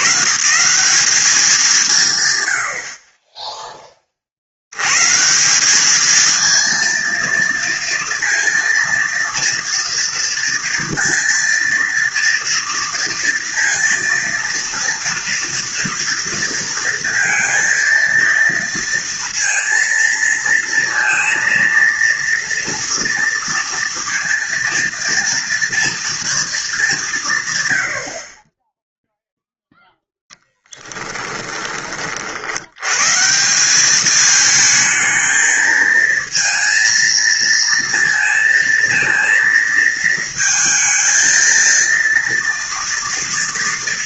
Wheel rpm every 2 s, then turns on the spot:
130, 100, 70, 230, 230, 230, 230, 230, 230, 230, 230, 230, 230, 210, 20, 10, 80, 220, 230, 230, 230, 230.
none